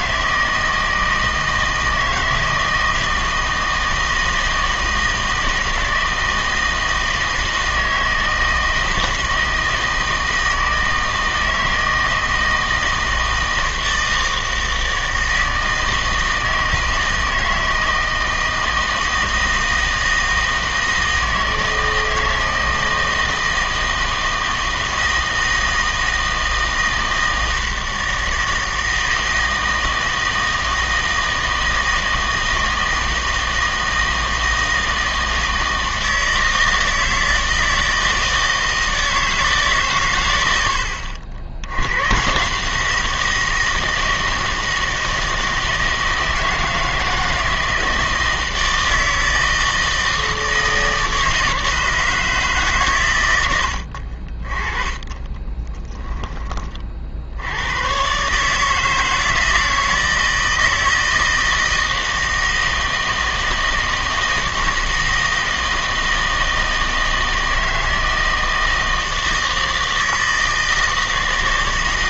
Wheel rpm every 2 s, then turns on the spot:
160, 160, 160, 160, 160, 160, 160, 160, 160, 160, 160, 160, 160, 160, 160, 160, 160, 160, 160, 160, 80, 160, 160, 160, 160, 160, 140, 30, 30, 160, 160, 160, 160, 160, 160, 160.
54-56